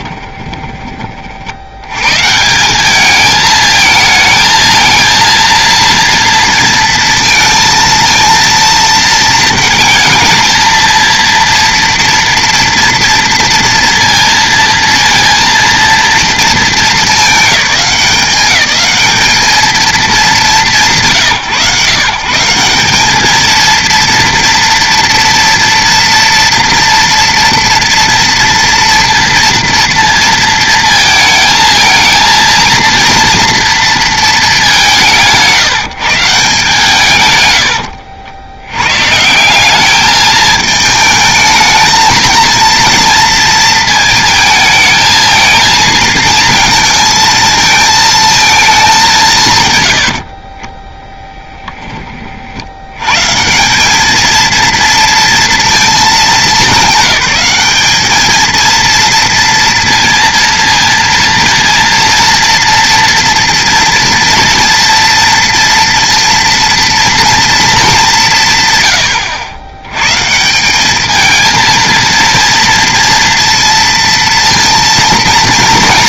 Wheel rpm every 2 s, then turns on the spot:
20, 190, 220, 230, 230, 230, 230, 230, 220, 190, 150, 200, 240, 230, 230, 230, 230, 200, 140, 100, 220, 230, 220, 220, 210, 20, 60, 230, 200, 230, 230, 230, 230, 230, 140, 190, 230, 230.
0-2